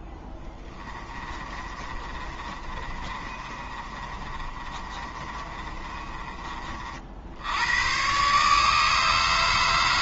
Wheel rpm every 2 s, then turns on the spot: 10, 30, 30, 40, 150.
0-6